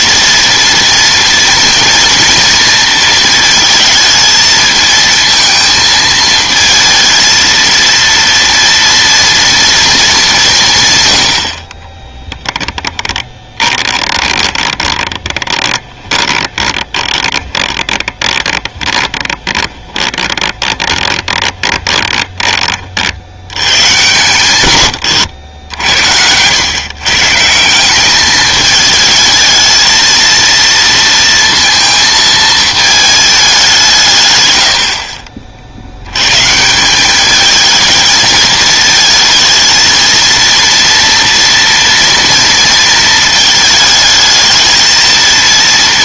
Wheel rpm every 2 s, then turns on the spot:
230, 230, 220, 220, 230, 150, 10, 20, 20, 20, 20, 30, 110, 110, 220, 230, 220, 70, 160, 220, 230, 230, 220.
12-22